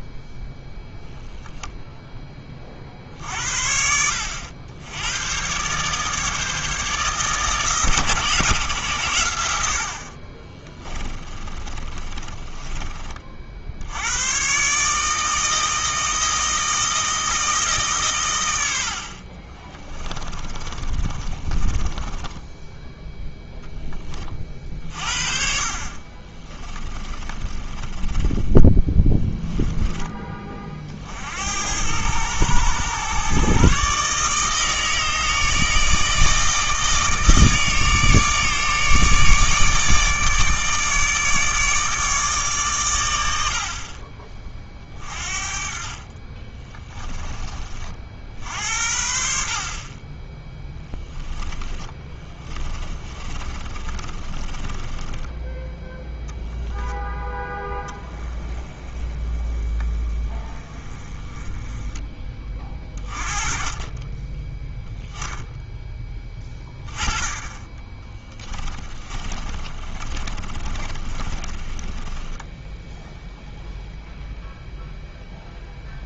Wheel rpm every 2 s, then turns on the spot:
0, 40, 90, 150, 130, 30, 30, 140, 160, 80, 30, 0, 40, 30, 10, 40, 120, 160, 160, 150, 150, 120, 30, 20, 70, 10, 20, 20, 0, 20, 20, 30, 10, 20, 20, 30, 10, 0.
10-14 20-22 26-30 46-48 50-56 68-74